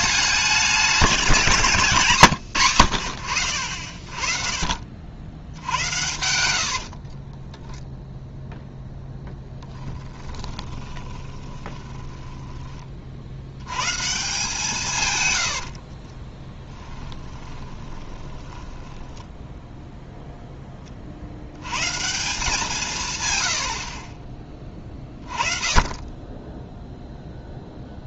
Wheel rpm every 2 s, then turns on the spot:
200, 120, 40, 100, 0, 20, 20, 170, 10, 20, 10, 170, 20, 10.
6-8 10-12 16-20